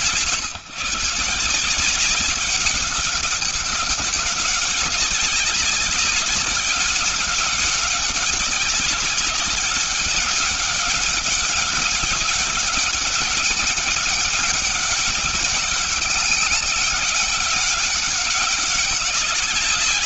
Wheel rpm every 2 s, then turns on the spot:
130, 200, 200, 200, 200, 200, 190, 200, 200, 190.
none